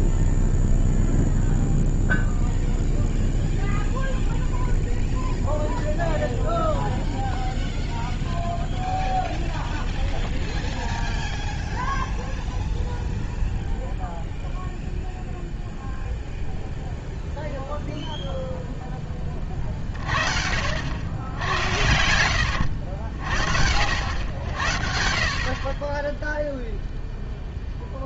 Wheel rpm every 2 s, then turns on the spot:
0, 0, 0, 0, 0, 0, 0, 0, 0, 0, 50, 90, 70, 0.
none